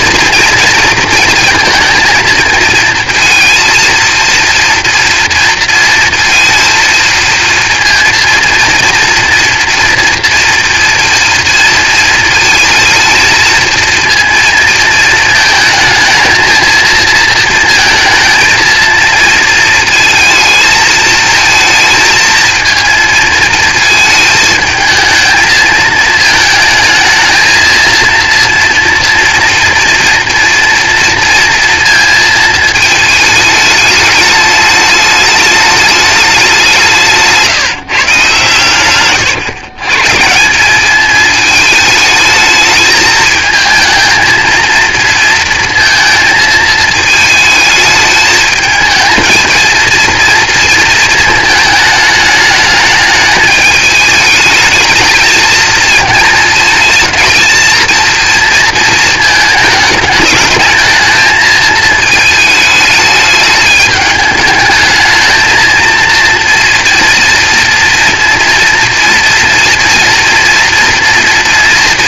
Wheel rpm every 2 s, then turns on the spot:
230, 230, 230, 230, 230, 230, 230, 230, 220, 220, 220, 220, 220, 220, 230, 230, 220, 210, 190, 130, 190, 220, 230, 220, 220, 230, 220, 220, 220, 230, 220, 220, 210, 230, 240, 240.
none